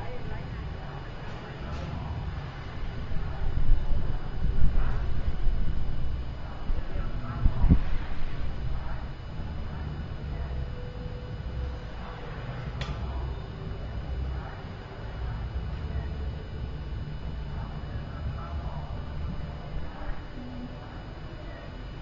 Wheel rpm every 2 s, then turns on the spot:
0, 0, 0, 0, 0, 0, 0, 0, 0, 0, 0.
none